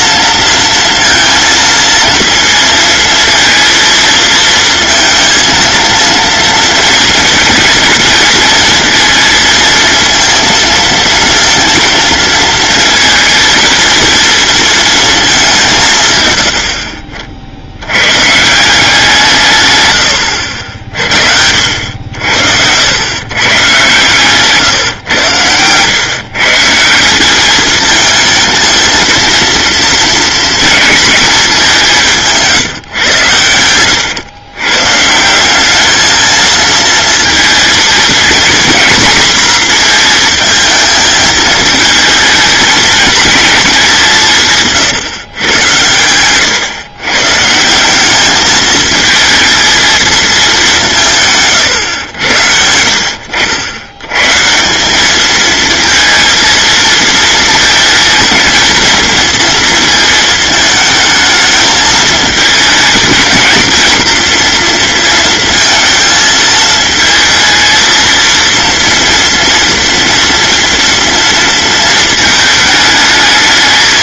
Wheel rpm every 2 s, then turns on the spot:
230, 230, 230, 230, 230, 230, 230, 230, 60, 170, 60, 90, 130, 170, 220, 230, 130, 130, 230, 230, 220, 220, 150, 120, 220, 190, 80, 180, 230, 230, 220, 220, 230, 220, 230, 230, 220.
none